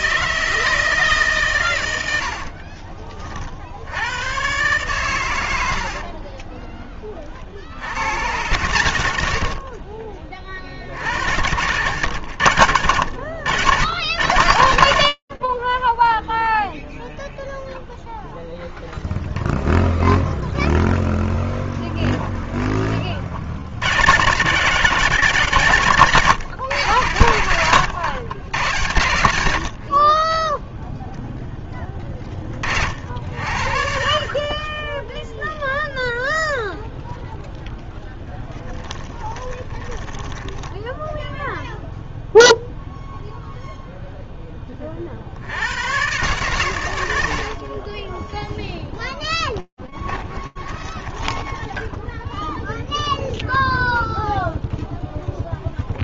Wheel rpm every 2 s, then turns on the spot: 160, 60, 110, 20, 110, 40, 100, 60, 0, 0, 0, 10, 140, 140, 110, 0, 50, 10, 0, 10, 0, 0, 40, 100, 10, 20, 0, 0.
6-8 38-40 48-52